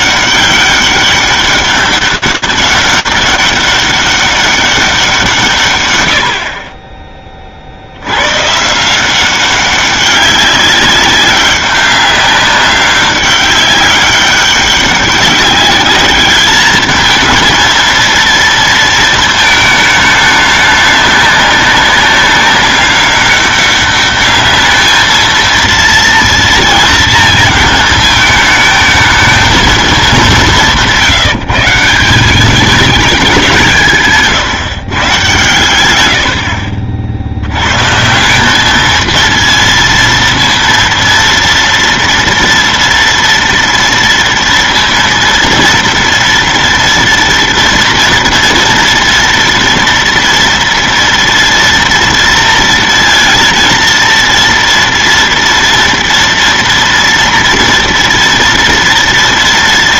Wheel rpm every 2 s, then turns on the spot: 200, 200, 200, 70, 130, 190, 200, 200, 210, 230, 210, 200, 210, 230, 220, 190, 190, 150, 80, 180, 230, 230, 230, 230, 230, 240, 230, 230, 230, 230.
none